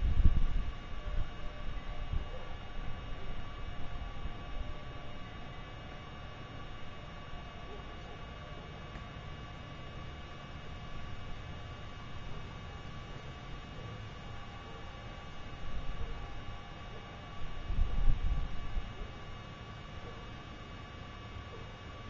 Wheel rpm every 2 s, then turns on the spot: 0, 0, 0, 0, 0, 0, 0, 0, 0, 0, 0.
none